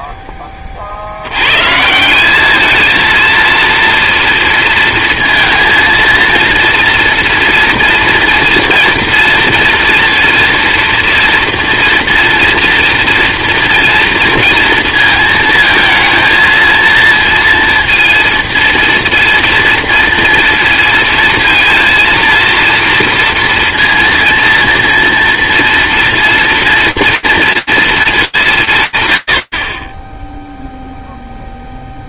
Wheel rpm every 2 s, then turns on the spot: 70, 230, 230, 230, 230, 230, 230, 230, 220, 230, 230, 230, 230, 230, 200, 0.
none